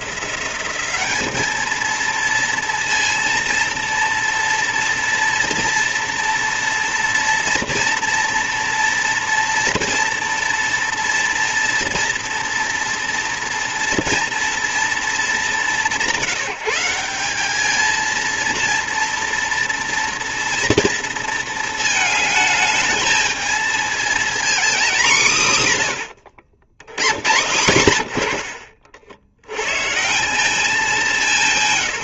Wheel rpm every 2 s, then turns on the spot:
200, 230, 230, 240, 240, 230, 230, 230, 180, 230, 230, 220, 220, 90, 60, 200.
none